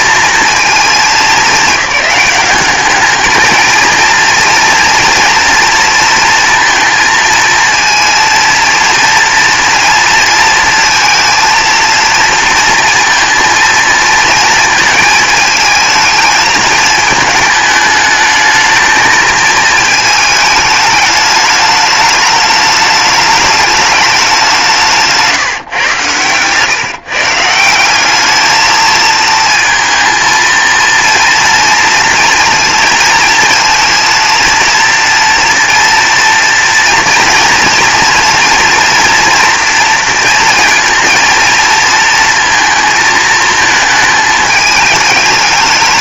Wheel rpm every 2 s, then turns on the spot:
210, 210, 240, 230, 230, 230, 230, 220, 220, 220, 210, 210, 170, 140, 220, 230, 230, 240, 230, 230, 230, 230, 210.
none